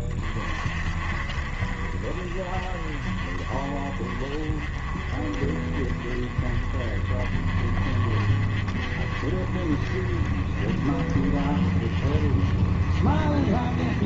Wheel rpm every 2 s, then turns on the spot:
40, 40, 40, 30, 40, 40, 40.
none